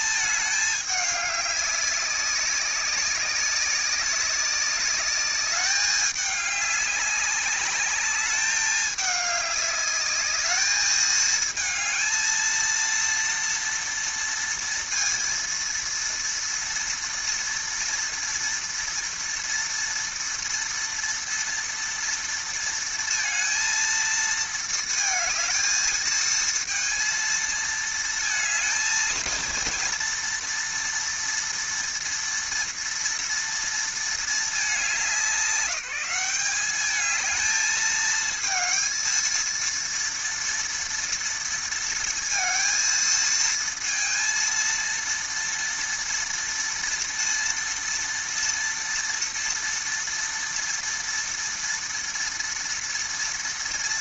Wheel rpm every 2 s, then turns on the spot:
210, 200, 200, 200, 200, 220, 230, 230, 230, 230, 230, 230, 220, 230, 230, 230, 230, 200, 210, 230, 230, 230, 230, 230, 230, 230, 230.
none